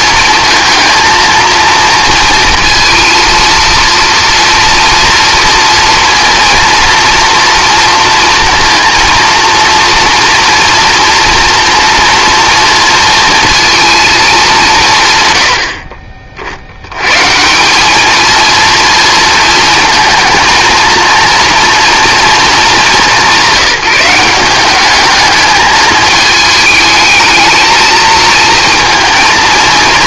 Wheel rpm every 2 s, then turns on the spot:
230, 230, 230, 230, 230, 230, 230, 140, 100, 230, 230, 200, 200, 220, 230.
none